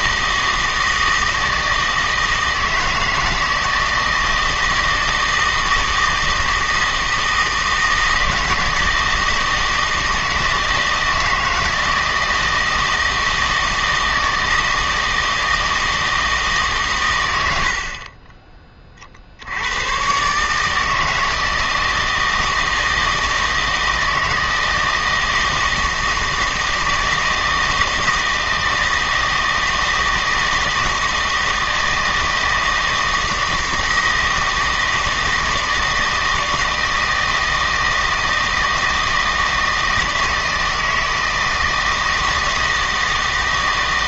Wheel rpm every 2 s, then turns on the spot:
160, 160, 160, 160, 160, 160, 160, 160, 140, 30, 150, 160, 160, 160, 160, 160, 160, 160, 160, 160, 160, 160.
none